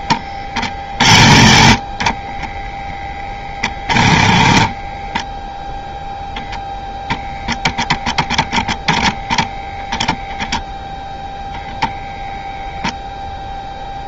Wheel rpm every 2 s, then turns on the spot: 50, 10, 20, 0, 10, 0, 0.
none